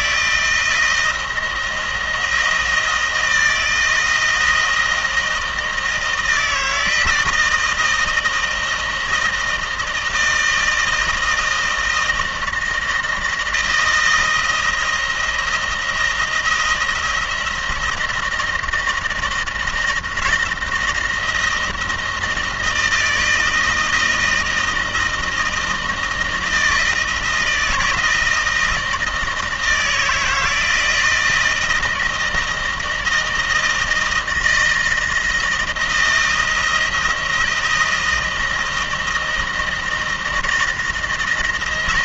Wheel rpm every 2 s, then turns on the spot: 170, 170, 160, 160, 160, 160, 160, 160, 160, 170, 170, 170, 160, 160, 170, 160, 160, 160, 160, 160, 160.
none